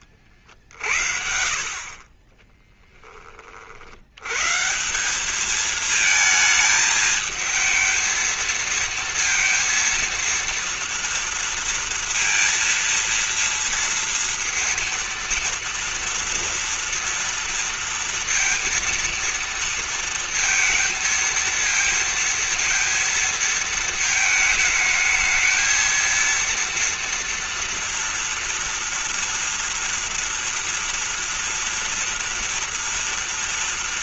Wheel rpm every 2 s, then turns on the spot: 70, 20, 140, 220, 220, 230, 230, 230, 230, 230, 230, 230, 220, 230, 230, 230, 230.
2-4